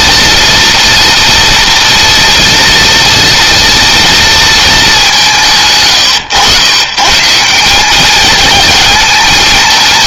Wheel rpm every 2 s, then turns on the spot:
230, 230, 150, 140, 220.
none